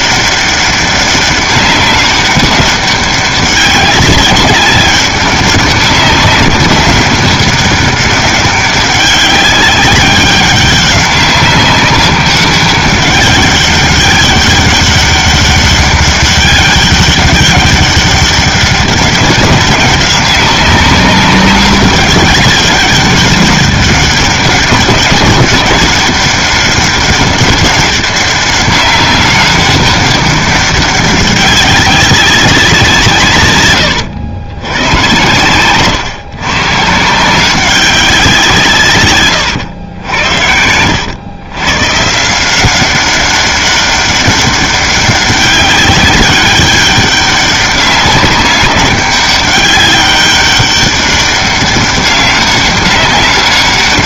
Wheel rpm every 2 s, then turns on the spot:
200, 200, 190, 200, 200, 200, 200, 200, 200, 200, 190, 200, 200, 200, 200, 200, 190, 100, 140, 180, 80, 160, 200, 200, 200, 200, 200.
40-42